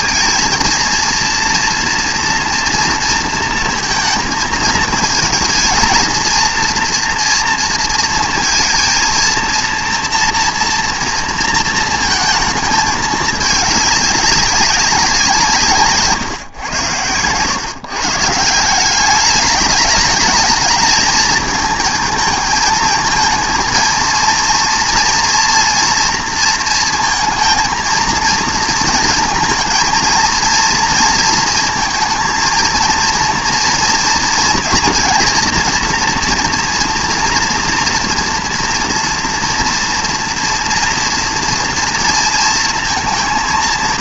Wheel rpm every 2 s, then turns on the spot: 230, 230, 220, 230, 230, 230, 220, 190, 110, 180, 220, 220, 230, 230, 230, 230, 230, 230, 230, 230, 230, 230.
none